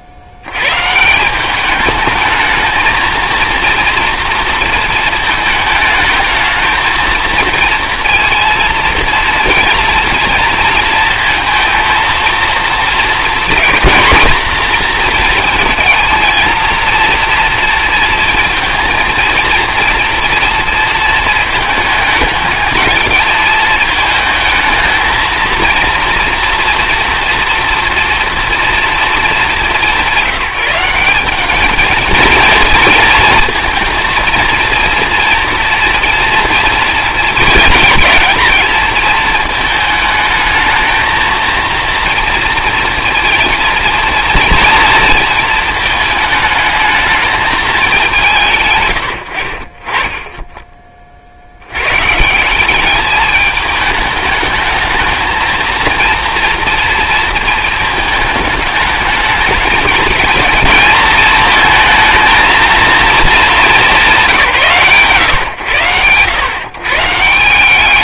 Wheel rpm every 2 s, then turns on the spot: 110, 220, 230, 220, 230, 230, 230, 230, 220, 230, 230, 220, 220, 230, 230, 160, 230, 230, 230, 220, 220, 230, 230, 220, 140, 20, 190, 210, 230, 210, 220, 230, 170, 120.
none